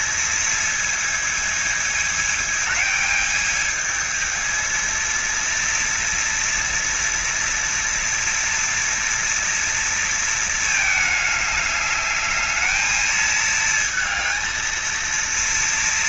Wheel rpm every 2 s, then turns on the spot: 220, 220, 230, 240, 230, 220, 220, 230.
none